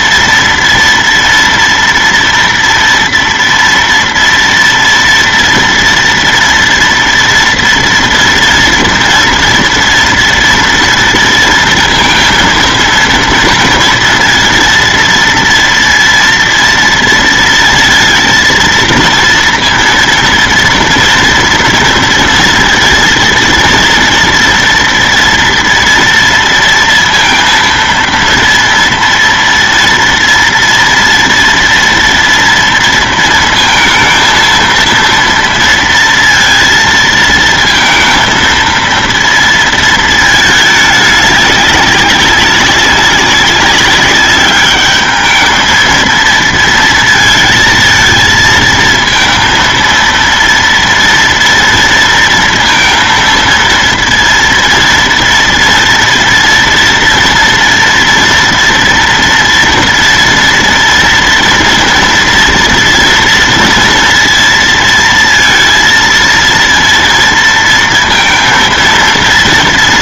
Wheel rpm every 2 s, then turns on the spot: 230, 240, 230, 230, 230, 230, 230, 230, 230, 230, 230, 230, 230, 230, 230, 230, 230, 230, 230, 230, 210, 200, 200, 230, 230, 230, 230, 230, 230, 230, 230, 230, 230, 230, 230.
none